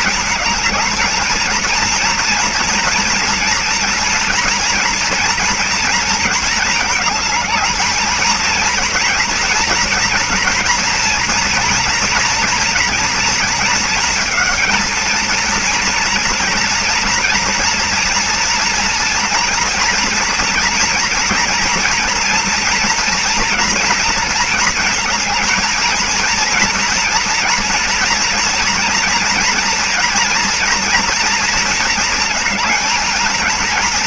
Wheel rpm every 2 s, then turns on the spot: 220, 230, 230, 230, 230, 240, 240, 220, 230, 230, 230, 230, 230, 230, 230, 230, 220.
none